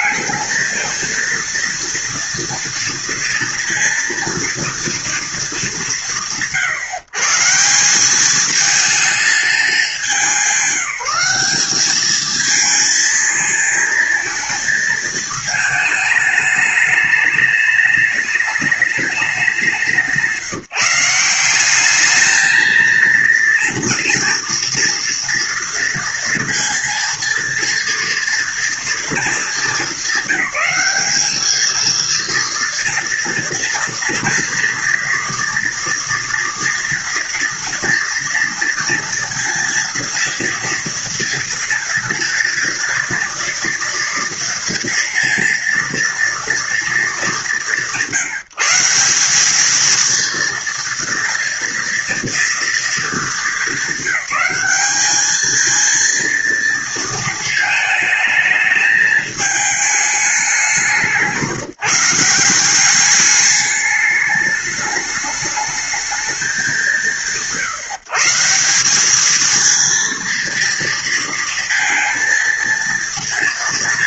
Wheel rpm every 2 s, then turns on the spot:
220, 230, 230, 130, 210, 200, 220, 220, 210, 210, 160, 220, 230, 230, 240, 200, 230, 230, 230, 230, 230, 230, 230, 230, 180, 230, 230, 200, 230, 220, 210, 180, 210, 190, 170, 230, 230.
none